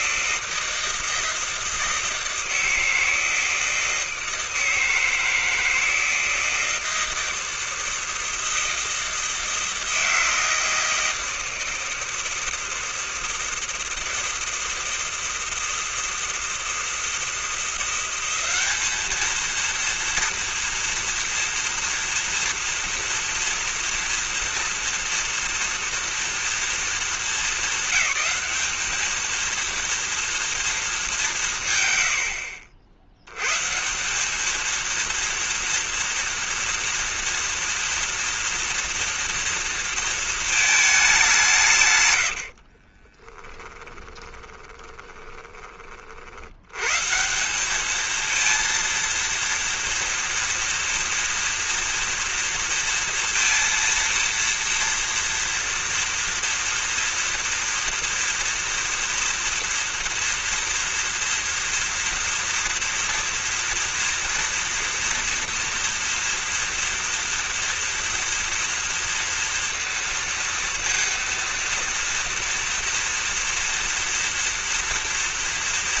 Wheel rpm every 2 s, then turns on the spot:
160, 160, 160, 160, 160, 160, 160, 160, 160, 180, 230, 230, 240, 240, 200, 230, 100, 190, 230, 240, 220, 100, 20, 40, 220, 230, 230, 230, 230, 230, 230, 230, 240, 230, 230, 230, 230, 230.
42-46